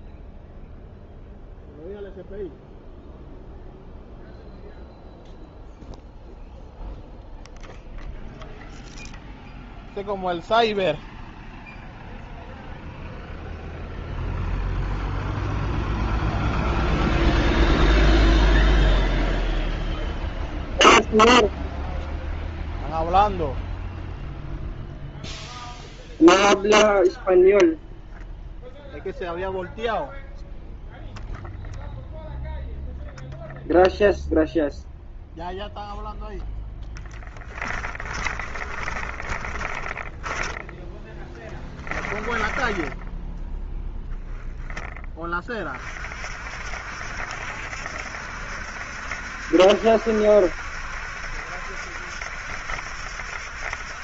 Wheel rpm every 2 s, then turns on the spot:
0, 0, 0, 0, 0, 0, 0, 0, 0, 0, 0, 0, 0, 0, 0, 0, 0, 0, 10, 30, 10, 20, 10, 60, 70, 70, 70.
38-44